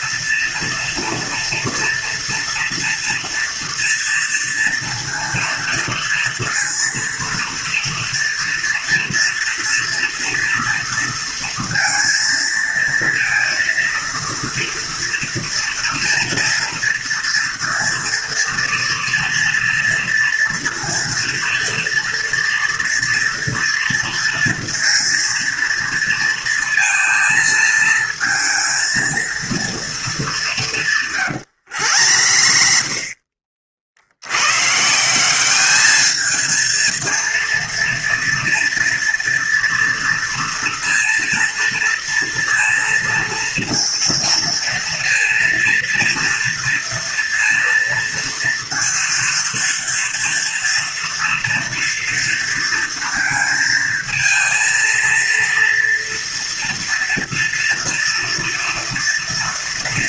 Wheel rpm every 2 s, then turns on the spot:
230, 230, 230, 230, 230, 230, 230, 230, 230, 230, 230, 230, 230, 230, 230, 200, 60, 120, 230, 230, 230, 230, 230, 230, 230, 240, 230, 230, 230, 230.
32-34